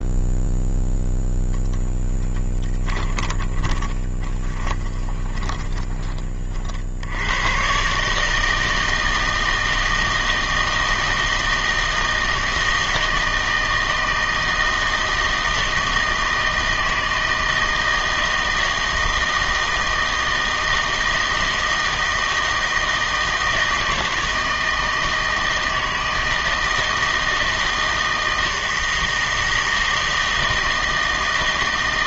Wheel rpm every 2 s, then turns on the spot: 0, 10, 20, 40, 160, 160, 160, 160, 160, 160, 160, 160, 160, 160, 160, 160.
2-6